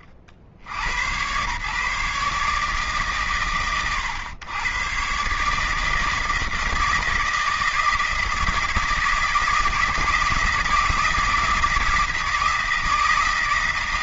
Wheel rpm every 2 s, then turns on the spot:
90, 140, 120, 160, 160, 160, 160.
none